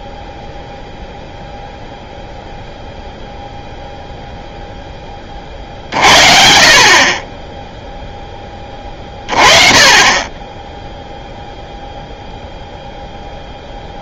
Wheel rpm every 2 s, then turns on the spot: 0, 0, 10, 50, 20, 10, 0.
none